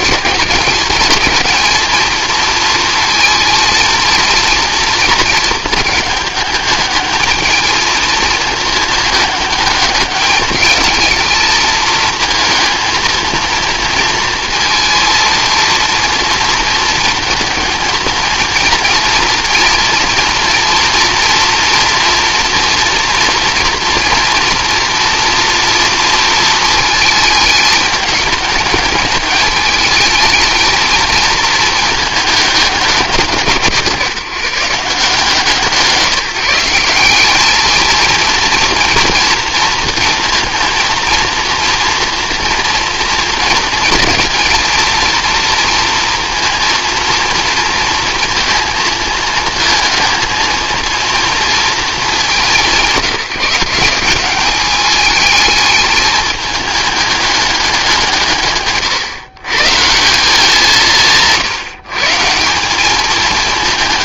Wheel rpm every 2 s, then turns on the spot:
220, 220, 230, 220, 220, 220, 230, 230, 230, 230, 230, 230, 230, 220, 210, 220, 210, 150, 180, 230, 230, 230, 230, 230, 230, 230, 160, 200, 220, 130, 180, 200.
none